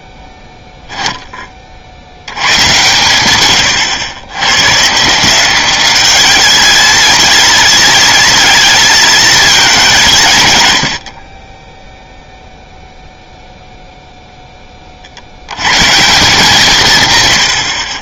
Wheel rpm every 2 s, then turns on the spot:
0, 120, 150, 230, 230, 80, 0, 20, 150.
none